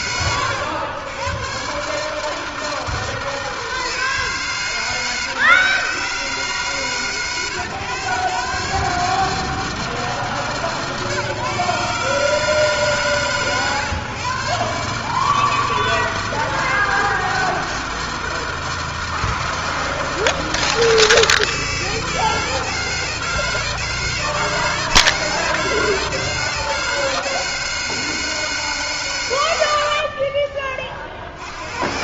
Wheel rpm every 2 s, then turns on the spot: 110, 160, 150, 130, 150, 140, 150, 150, 160, 160, 160, 160, 160, 160, 160, 30.
none